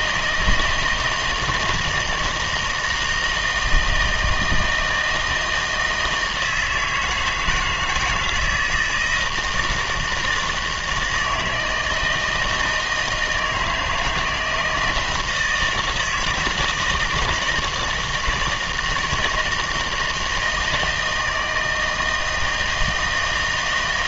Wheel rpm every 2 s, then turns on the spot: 160, 160, 160, 160, 160, 160, 160, 160, 170, 160, 160, 160.
none